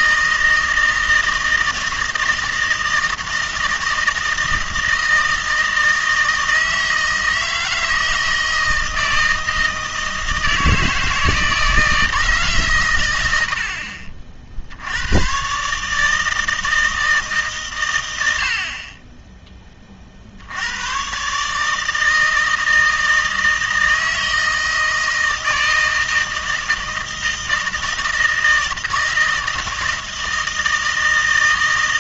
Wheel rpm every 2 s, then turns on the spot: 160, 160, 160, 160, 160, 160, 80, 140, 140, 10, 140, 160, 160, 160, 160, 160.
none